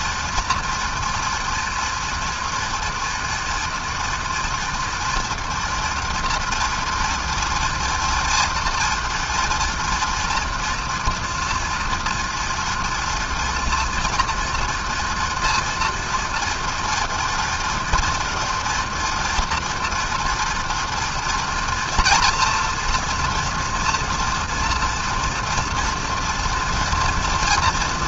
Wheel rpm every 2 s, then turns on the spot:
230, 230, 230, 230, 230, 230, 230, 230, 230, 230, 230, 230, 240, 230.
none